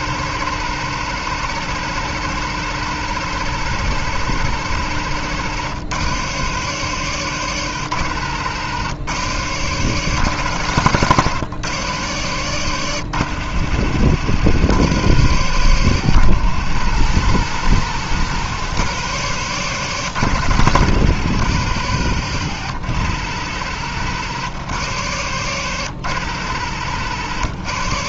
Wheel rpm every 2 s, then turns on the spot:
120, 120, 120, 130, 110, 120, 110, 120, 110, 120, 110, 110, 120, 110.
none